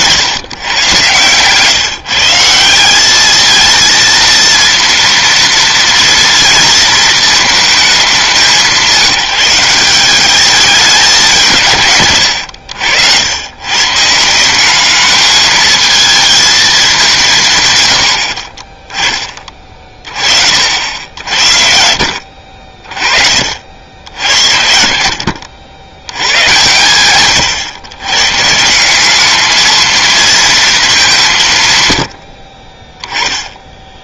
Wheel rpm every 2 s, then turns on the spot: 150, 180, 230, 230, 180, 200, 90, 180, 220, 20, 60, 50, 70, 110, 160, 230, 40.
none